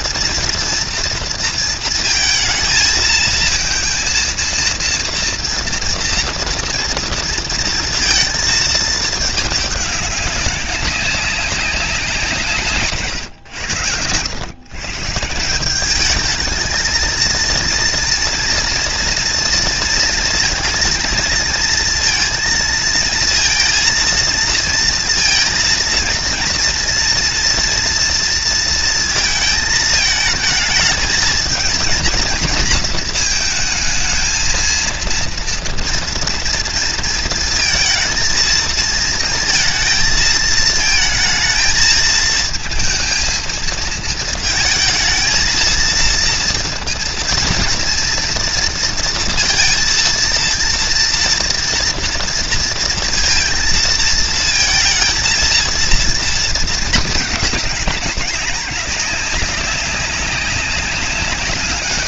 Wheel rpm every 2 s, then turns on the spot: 230, 220, 230, 230, 220, 190, 140, 150, 220, 230, 230, 230, 230, 240, 220, 220, 220, 230, 230, 220, 220, 230, 220, 230, 230, 230, 230, 220, 220, 190, 200.
none